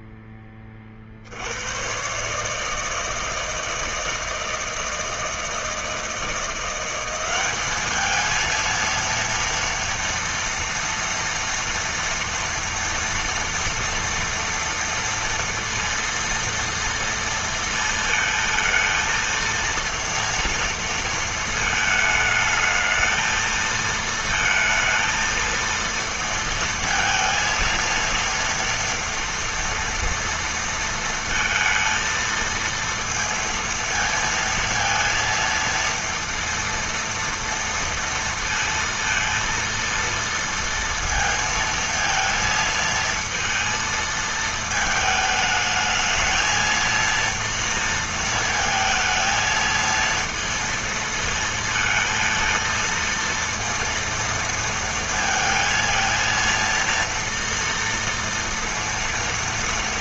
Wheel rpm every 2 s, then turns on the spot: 50, 160, 160, 190, 230, 230, 240, 230, 230, 230, 230, 220, 230, 220, 230, 230, 230, 230, 230, 230, 230, 230, 220, 230, 220, 230, 230, 230, 230, 230.
none